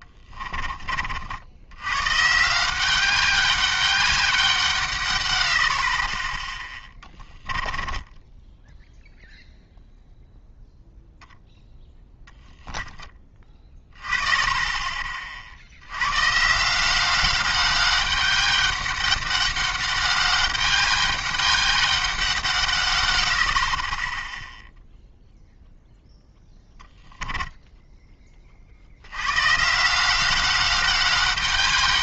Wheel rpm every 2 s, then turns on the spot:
30, 180, 150, 10, 0, 0, 0, 20, 170, 200, 200, 140, 0, 0, 60, 190.
6-8